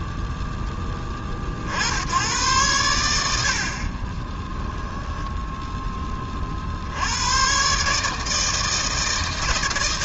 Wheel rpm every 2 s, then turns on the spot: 0, 100, 10, 40, 160.
4-6